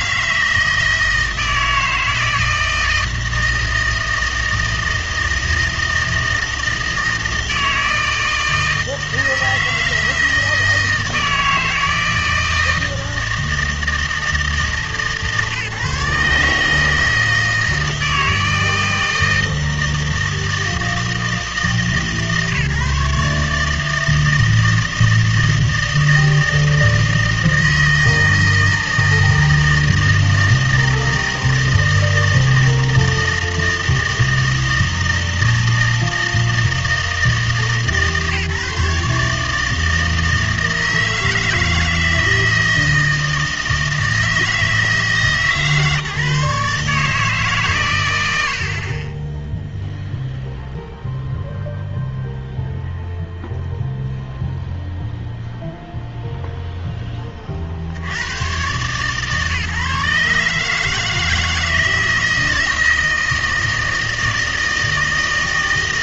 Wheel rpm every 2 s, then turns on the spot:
160, 160, 160, 160, 160, 160, 160, 160, 150, 160, 160, 140, 160, 160, 160, 160, 160, 160, 160, 150, 160, 160, 160, 150, 70, 0, 0, 0, 0, 110, 150, 160, 160.
none